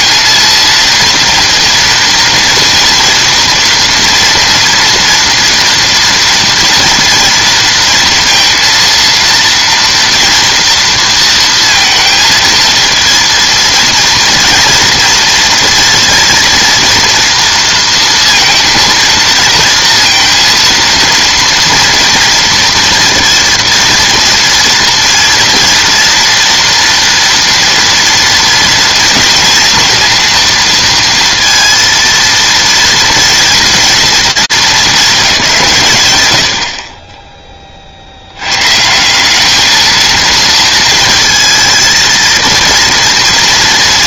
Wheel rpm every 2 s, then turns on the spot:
230, 230, 230, 230, 230, 230, 220, 230, 230, 230, 230, 230, 230, 230, 240, 230, 230, 220, 70, 120, 230, 230.
none